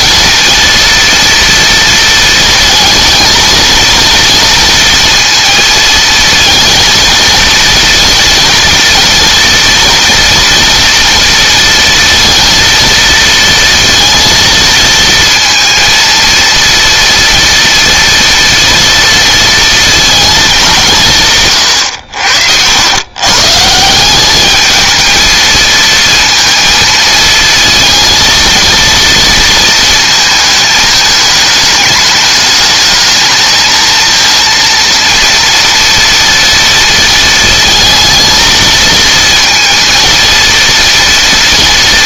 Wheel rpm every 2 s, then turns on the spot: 230, 230, 230, 230, 230, 230, 230, 230, 230, 230, 180, 100, 220, 230, 230, 210, 220, 230, 230, 230, 230.
none